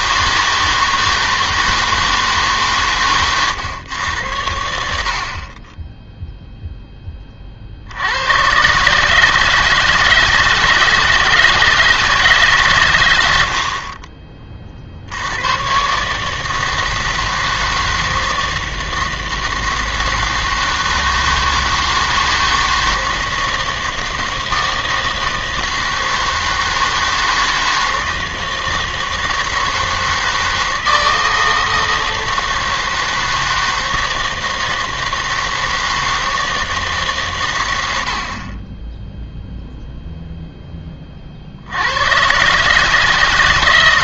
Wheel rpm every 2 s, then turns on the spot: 160, 140, 80, 0, 120, 160, 130, 40, 160, 160, 160, 160, 160, 160, 160, 160, 160, 160, 160, 40, 0, 140.
none